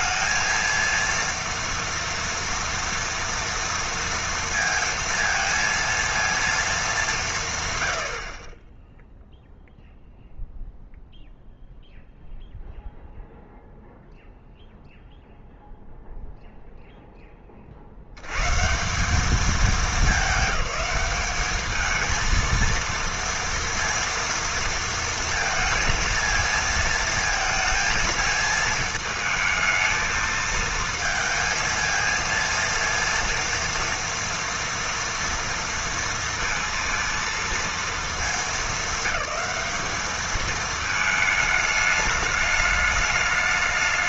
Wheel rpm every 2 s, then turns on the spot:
230, 230, 230, 220, 20, 0, 0, 0, 0, 140, 200, 230, 230, 230, 220, 220, 230, 230, 230, 200, 220, 210.
none